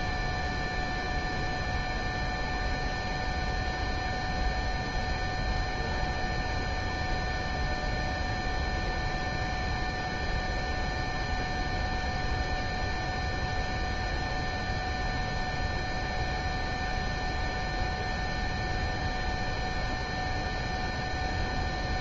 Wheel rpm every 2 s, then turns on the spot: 0, 0, 0, 0, 0, 0, 0, 0, 0, 0, 0.
none